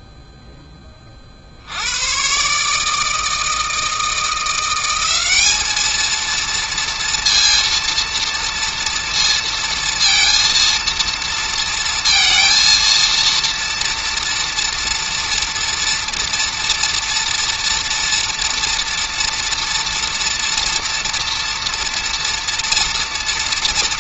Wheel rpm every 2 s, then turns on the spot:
10, 140, 170, 230, 230, 230, 230, 230, 230, 230, 240, 230.
none